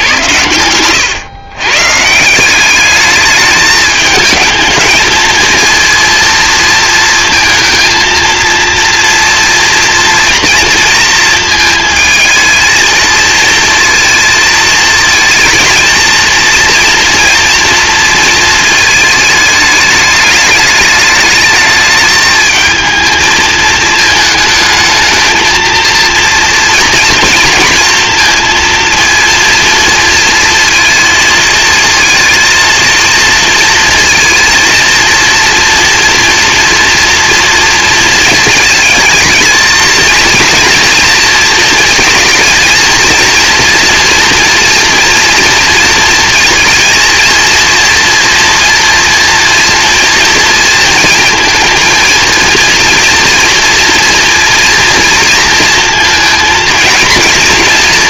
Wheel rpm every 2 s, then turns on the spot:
110, 200, 220, 230, 230, 230, 220, 220, 230, 220, 210, 220, 220, 230, 230, 230, 230, 230, 240, 220, 230, 230, 240, 230, 230, 230, 230, 230, 230.
0-2